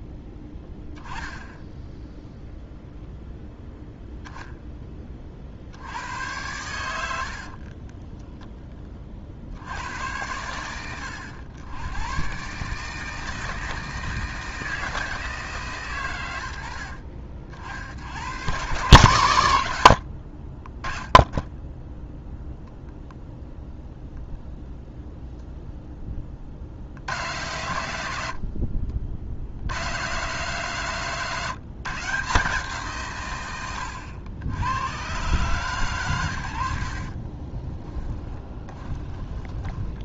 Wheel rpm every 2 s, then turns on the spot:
10, 0, 20, 90, 20, 90, 150, 160, 70, 130, 30, 0, 0, 60, 70, 150, 150, 100, 60, 20.
38-40